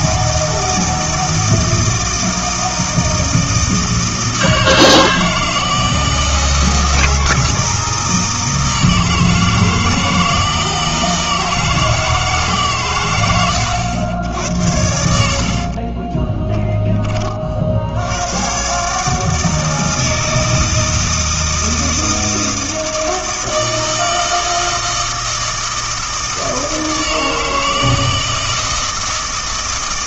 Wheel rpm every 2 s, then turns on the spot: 160, 160, 160, 160, 160, 160, 130, 90, 10, 140, 160, 160, 160, 160, 160.
none